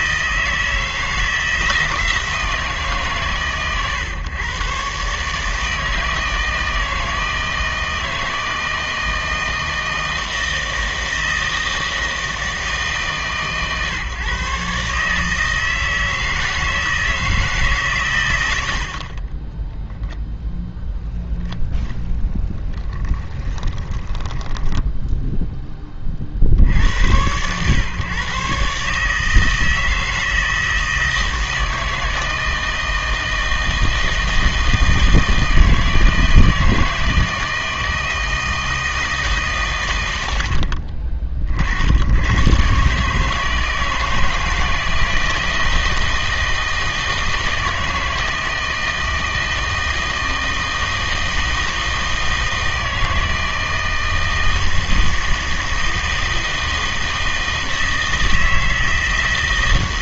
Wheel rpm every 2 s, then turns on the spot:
160, 160, 120, 160, 160, 160, 160, 140, 160, 80, 10, 10, 10, 60, 130, 160, 160, 160, 160, 160, 60, 130, 160, 160, 160, 160, 160, 160, 160, 160.
24-26